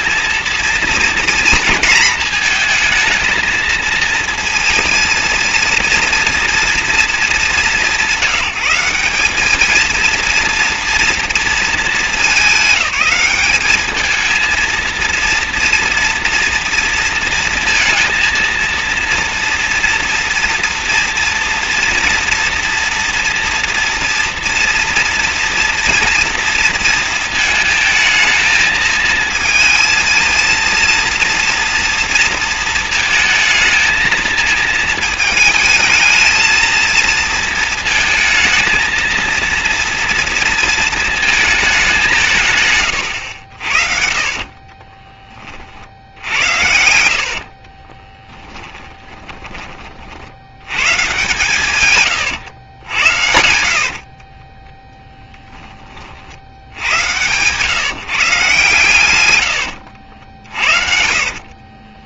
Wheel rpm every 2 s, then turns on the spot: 230, 220, 230, 230, 180, 230, 190, 220, 240, 230, 230, 230, 230, 230, 220, 230, 230, 220, 220, 220, 230, 140, 30, 80, 20, 100, 110, 20, 80, 140, 60.
44-50 54-56 60-62